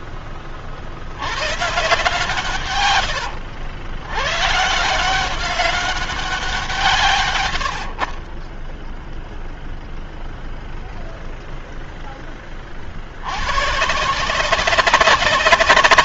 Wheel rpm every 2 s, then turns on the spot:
50, 120, 140, 170, 10, 0, 30, 180.
none